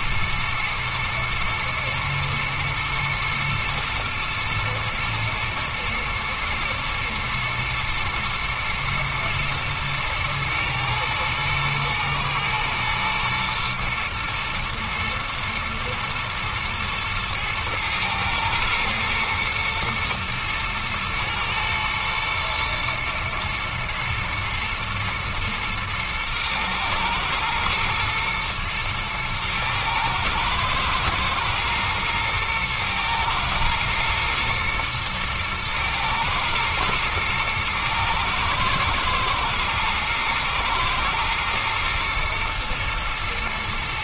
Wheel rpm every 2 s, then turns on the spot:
110, 110, 110, 110, 110, 110, 110, 110, 110, 110, 110, 120, 110, 110, 120, 120, 120, 120, 120, 110, 110, 120.
none